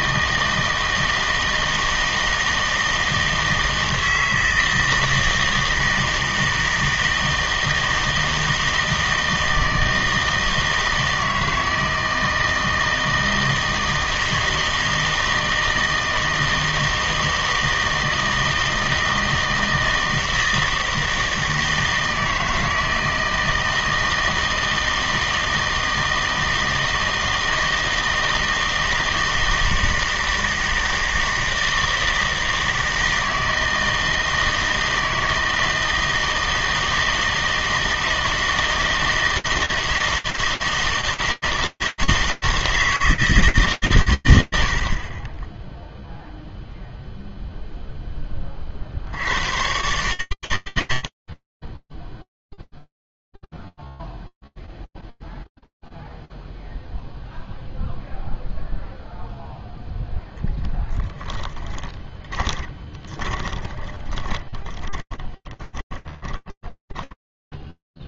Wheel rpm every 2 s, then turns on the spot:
160, 160, 160, 160, 160, 160, 160, 160, 160, 160, 160, 160, 160, 160, 160, 160, 160, 160, 160, 160, 160, 160, 90, 0, 50, 100, 0, 0, 0, 0, 10, 20, 20, 20.
62-68